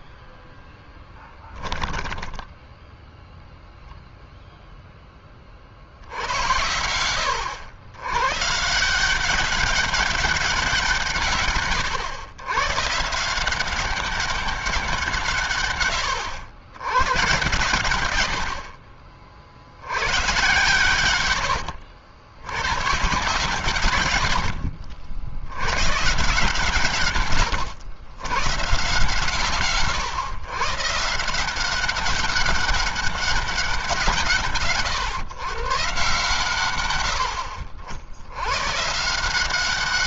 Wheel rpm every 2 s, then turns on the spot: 10, 10, 0, 90, 170, 170, 140, 190, 110, 60, 130, 120, 60, 120, 130, 140, 200, 130, 100, 140.
0-2